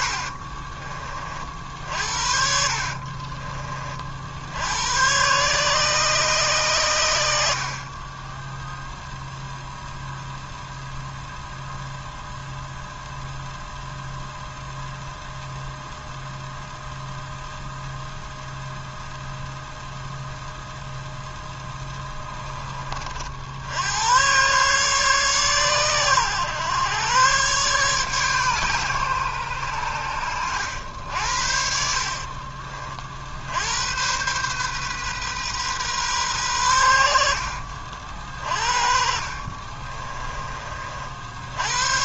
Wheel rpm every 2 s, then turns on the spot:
30, 40, 110, 110, 0, 0, 0, 0, 0, 0, 0, 40, 130, 120, 110, 70, 50, 130, 80, 40, 60.
2-4 38-40